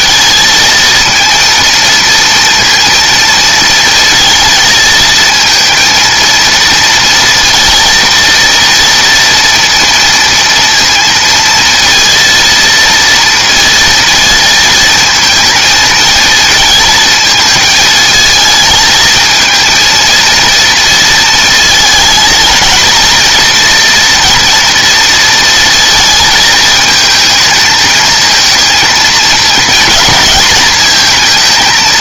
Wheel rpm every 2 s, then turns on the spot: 230, 230, 230, 230, 230, 230, 230, 230, 220, 220, 230, 220, 230, 220, 230, 230.
none